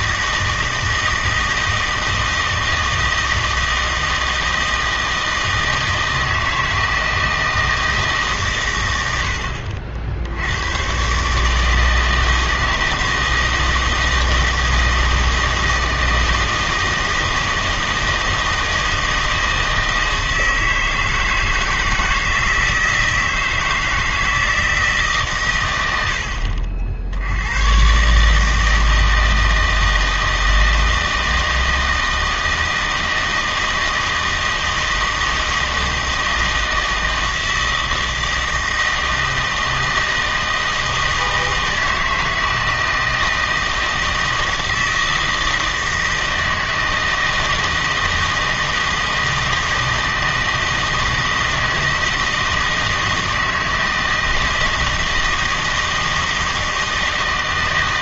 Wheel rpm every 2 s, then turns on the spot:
160, 160, 160, 160, 110, 120, 160, 160, 160, 160, 160, 160, 160, 70, 160, 160, 160, 160, 160, 160, 160, 160, 160, 160, 160, 160, 160, 160, 160.
none